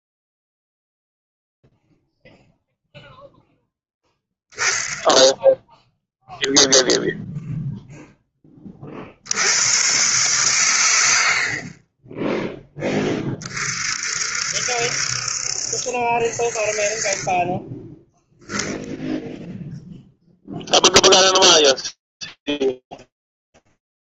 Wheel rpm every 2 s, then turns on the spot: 0, 0, 10, 0, 20, 130, 10, 60, 40, 0, 0, 0.
none